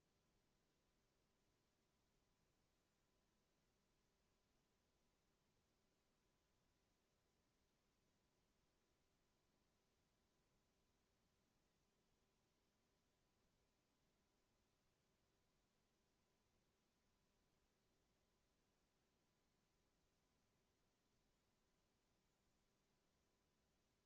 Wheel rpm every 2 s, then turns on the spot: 0, 0, 0, 0, 0, 0, 0, 0, 0, 0, 0, 0.
none